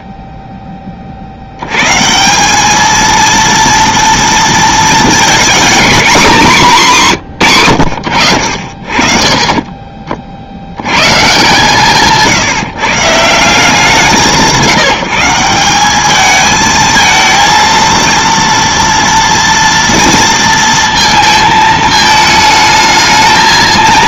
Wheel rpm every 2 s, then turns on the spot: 10, 200, 230, 220, 50, 80, 150, 160, 220, 230, 230, 220.
none